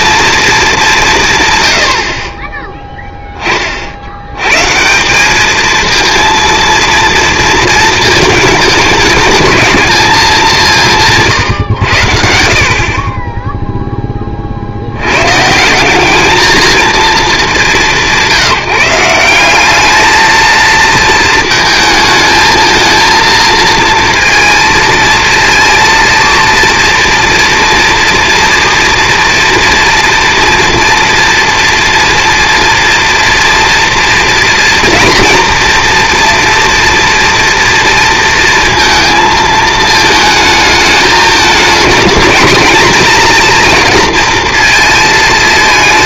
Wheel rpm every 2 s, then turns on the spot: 200, 10, 160, 230, 220, 170, 30, 90, 220, 170, 220, 230, 230, 230, 230, 240, 230, 230, 230, 230, 210, 220, 230.
none